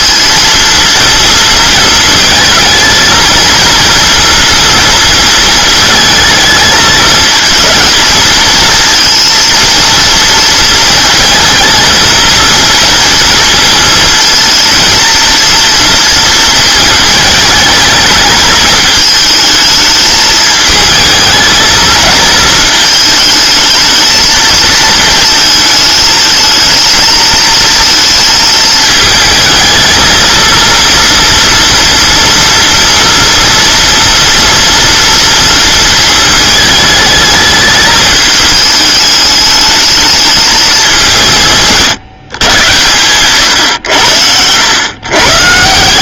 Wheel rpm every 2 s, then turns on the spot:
230, 230, 240, 220, 230, 230, 230, 230, 220, 220, 220, 220, 220, 220, 220, 230, 230, 230, 210, 210, 200, 120, 100.
none